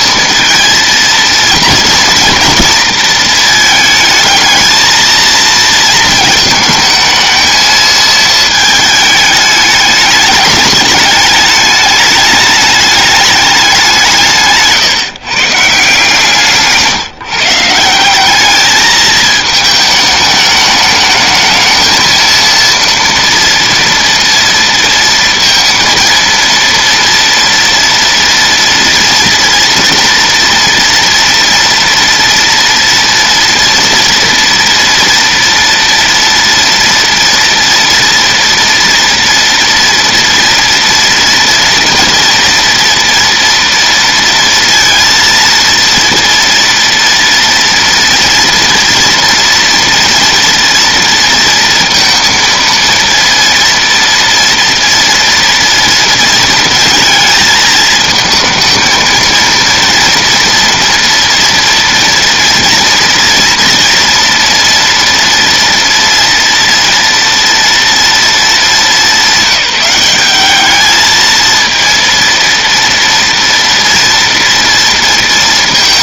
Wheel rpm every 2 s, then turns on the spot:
230, 220, 230, 220, 220, 210, 210, 150, 160, 220, 210, 230, 230, 230, 240, 230, 230, 230, 230, 230, 230, 230, 230, 230, 230, 230, 230, 230, 220, 220, 230, 240, 240, 230, 200, 210, 230, 230.
none